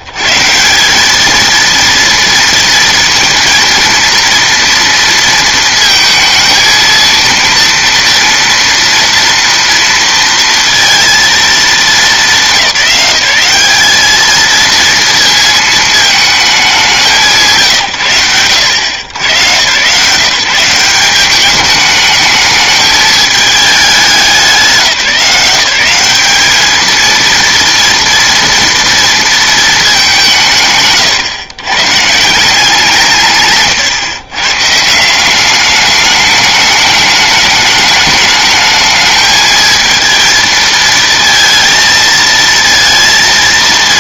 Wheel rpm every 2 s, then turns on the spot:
130, 230, 230, 220, 230, 230, 180, 230, 200, 100, 160, 220, 170, 210, 230, 160, 180, 140, 210, 210, 230, 230.
none